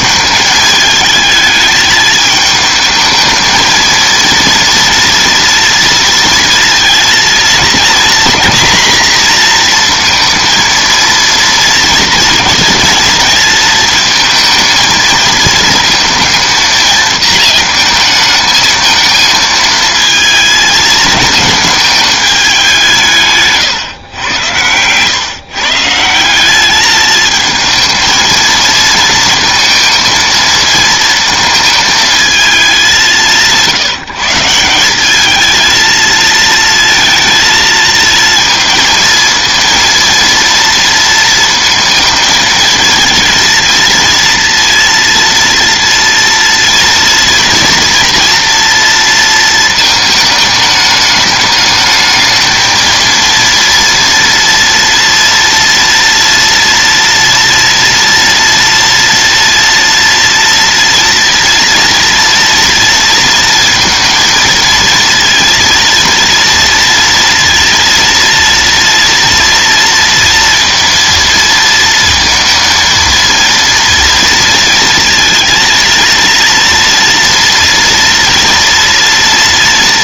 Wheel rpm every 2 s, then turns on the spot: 220, 220, 230, 230, 240, 230, 230, 230, 230, 220, 220, 170, 110, 210, 220, 220, 190, 190, 230, 220, 230, 220, 230, 230, 230, 210, 230, 230, 230, 230, 240, 230, 230, 230, 230, 230, 230, 230, 230, 230.
none